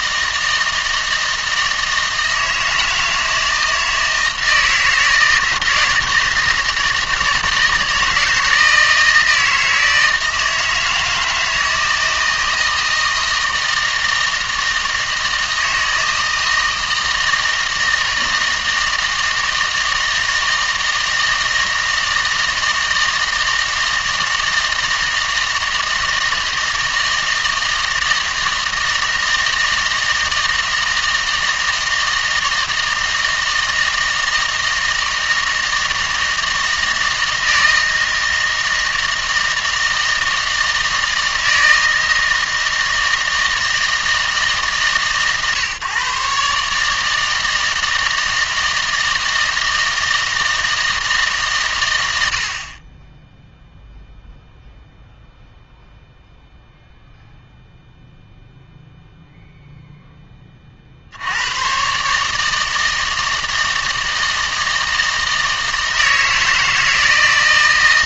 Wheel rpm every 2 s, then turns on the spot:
160, 160, 160, 160, 160, 160, 160, 160, 160, 160, 160, 160, 160, 160, 160, 160, 160, 170, 160, 160, 160, 160, 140, 140, 160, 160, 40, 0, 0, 0, 40, 160, 160, 160.
none